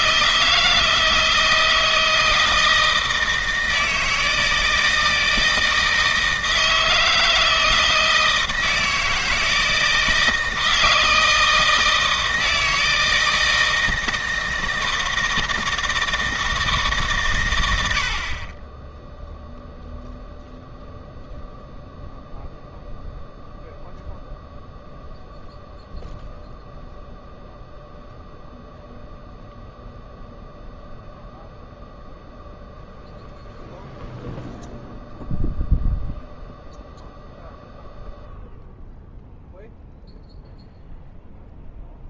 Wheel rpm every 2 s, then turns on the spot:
160, 160, 160, 160, 160, 160, 160, 160, 160, 20, 0, 0, 0, 0, 0, 0, 0, 0, 0, 0, 0.
none